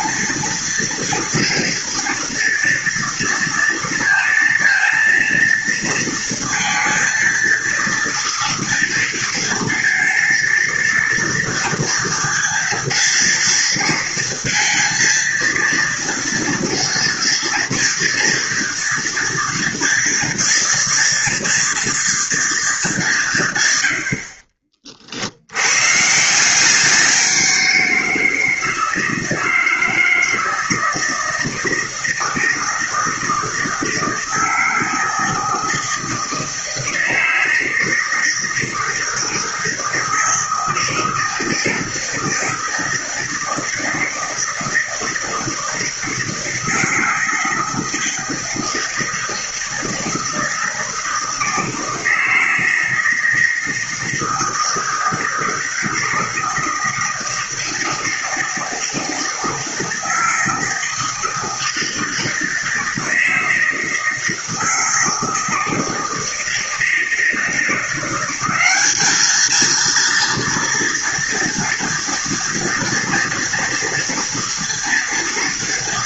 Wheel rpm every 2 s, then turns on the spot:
230, 230, 230, 230, 230, 230, 230, 230, 230, 230, 230, 210, 50, 180, 160, 160, 160, 160, 160, 160, 160, 160, 160, 160, 160, 160, 160, 160, 160, 160, 160, 160, 160, 160, 200, 230, 230, 230.
none